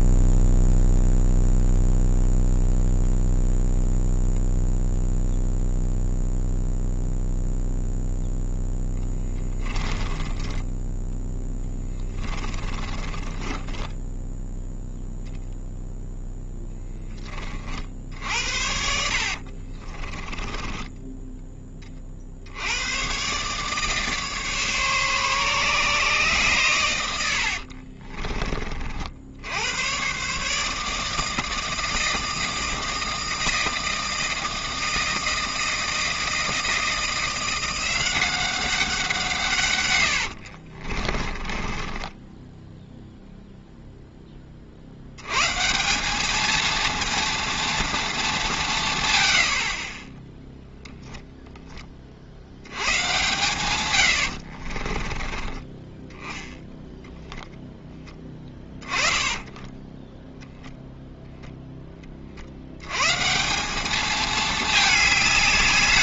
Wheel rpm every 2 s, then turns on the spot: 0, 0, 0, 0, 0, 10, 20, 0, 10, 60, 10, 90, 140, 120, 30, 150, 160, 160, 160, 190, 50, 10, 50, 220, 170, 0, 90, 40, 10, 10, 0, 80, 220.
10-14 20-22 40-44 54-56 58-60